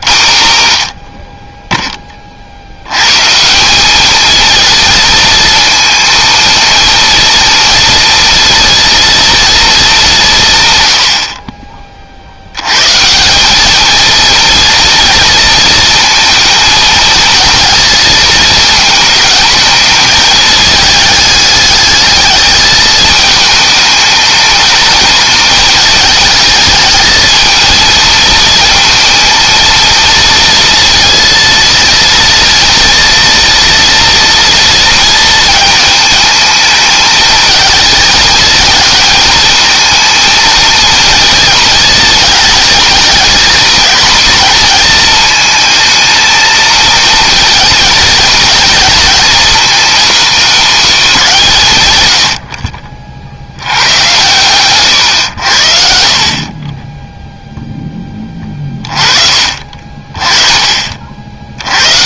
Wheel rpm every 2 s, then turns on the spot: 80, 100, 230, 230, 230, 110, 130, 230, 230, 220, 210, 220, 220, 220, 230, 230, 230, 220, 220, 220, 230, 230, 230, 230, 230, 220, 40, 120, 10, 20, 50.
none